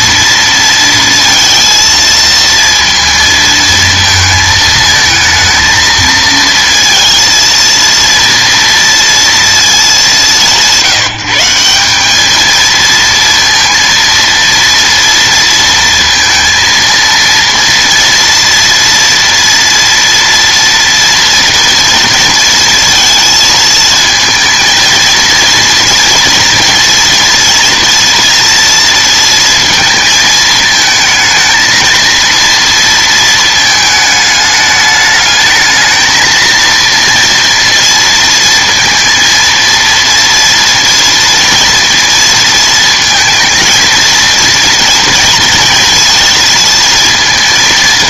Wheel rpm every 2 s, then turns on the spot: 230, 230, 220, 230, 230, 160, 220, 230, 230, 230, 230, 230, 230, 230, 230, 220, 230, 210, 230, 230, 230, 230, 230, 230.
none